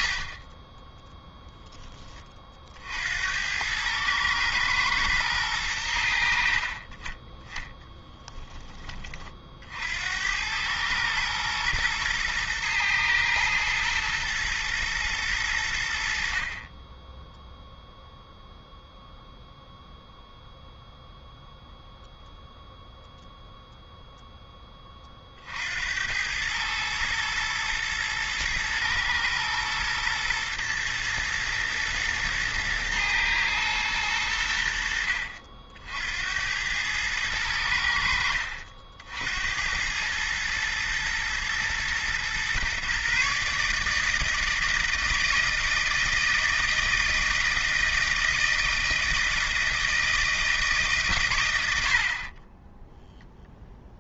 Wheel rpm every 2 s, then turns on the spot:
10, 60, 110, 40, 20, 110, 110, 110, 20, 0, 0, 0, 20, 110, 120, 120, 110, 70, 100, 60, 110, 130, 160, 160, 160, 150, 10.
0-2 52-54